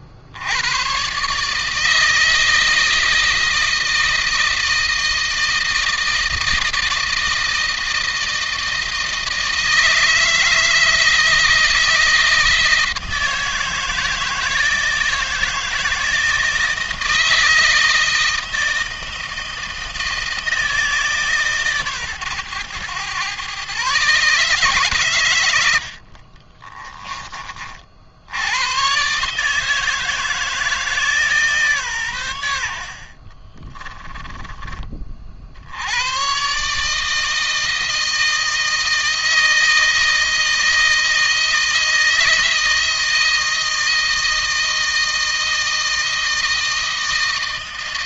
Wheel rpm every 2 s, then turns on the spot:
90, 160, 160, 160, 160, 160, 160, 160, 160, 160, 160, 120, 140, 30, 100, 160, 80, 30, 130, 160, 160, 160, 160, 160.
26-28 32-34